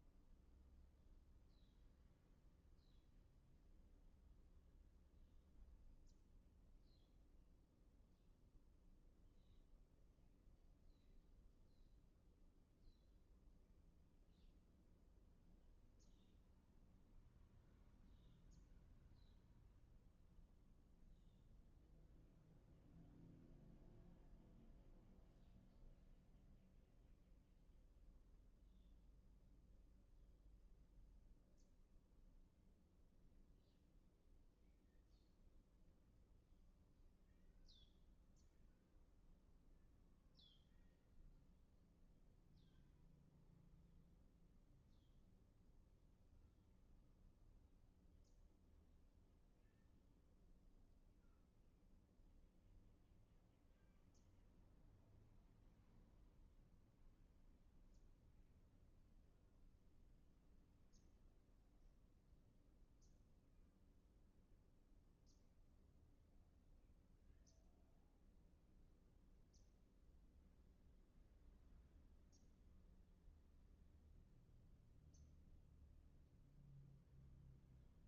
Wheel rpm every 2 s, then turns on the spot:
0, 0, 0, 0, 0, 0, 0, 0, 0, 0, 0, 0, 0, 0, 0, 0, 0, 0, 0, 0, 0, 0, 0, 0, 0, 0, 0, 0, 0, 0, 0, 0, 0, 0, 0, 0, 0, 0, 0.
none